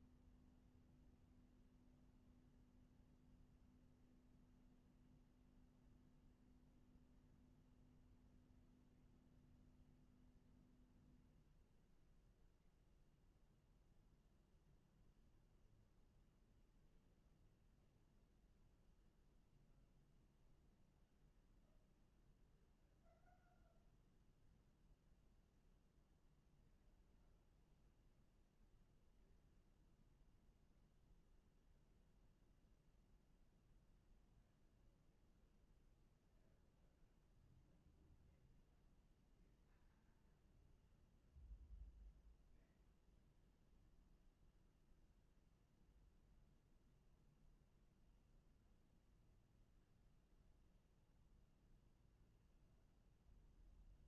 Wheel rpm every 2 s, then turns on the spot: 0, 0, 0, 0, 0, 0, 0, 0, 0, 0, 0, 0, 0, 0, 0, 0, 0, 0, 0, 0, 0, 0, 0, 0, 0, 0, 0.
none